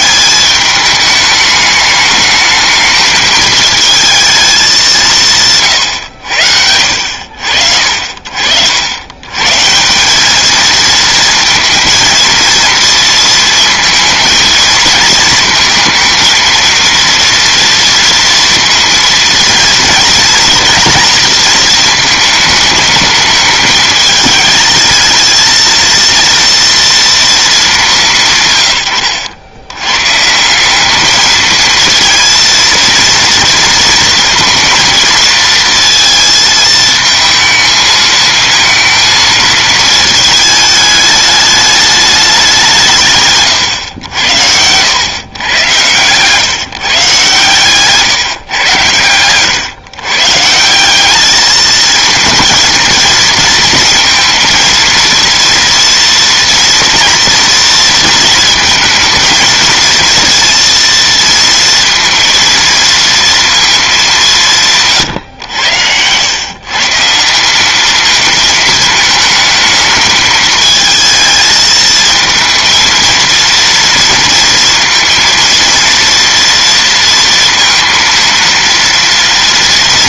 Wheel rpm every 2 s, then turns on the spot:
210, 220, 200, 70, 90, 230, 230, 220, 230, 230, 220, 210, 220, 230, 110, 200, 230, 230, 220, 230, 210, 170, 100, 150, 110, 180, 230, 230, 230, 220, 230, 230, 140, 140, 220, 220, 230, 230, 230, 230.
64-66